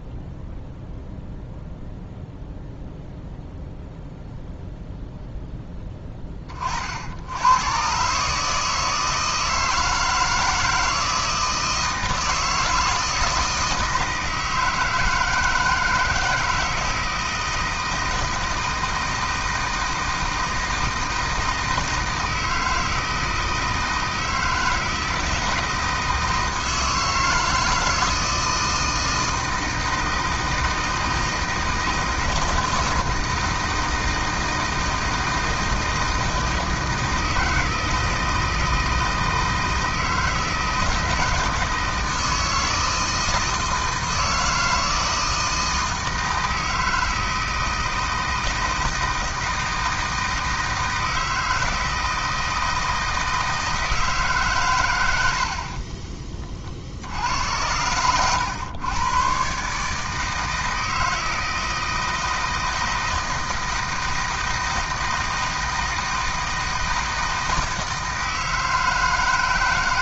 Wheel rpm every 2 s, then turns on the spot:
0, 0, 0, 30, 150, 160, 160, 160, 160, 160, 160, 160, 160, 160, 160, 160, 160, 160, 160, 160, 160, 160, 160, 160, 160, 160, 160, 130, 30, 110, 160, 160, 160, 160, 160.
none